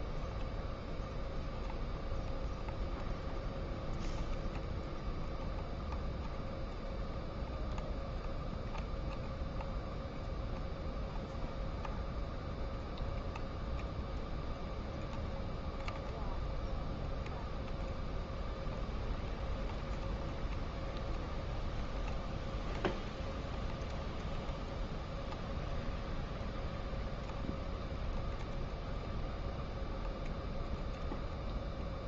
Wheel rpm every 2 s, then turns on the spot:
0, 0, 0, 0, 0, 0, 0, 0, 0, 0, 0, 0, 0, 0, 0, 0.
none